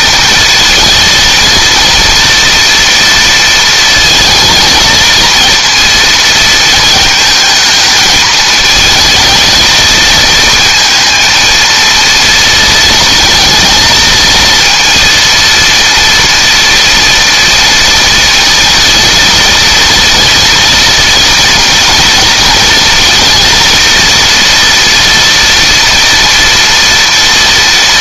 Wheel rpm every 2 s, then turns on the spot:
230, 230, 220, 220, 220, 230, 230, 230, 230, 230, 230, 230, 230, 240.
none